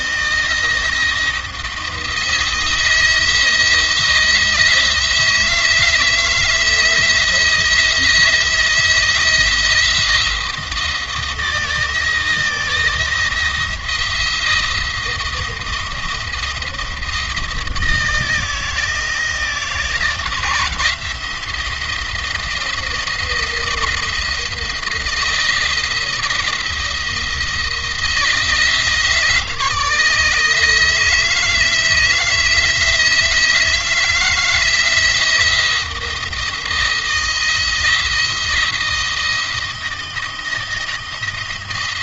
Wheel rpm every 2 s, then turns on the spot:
170, 160, 170, 170, 170, 170, 170, 170, 170, 170, 170, 170, 170, 170, 160, 160, 160, 160, 170, 170, 170.
none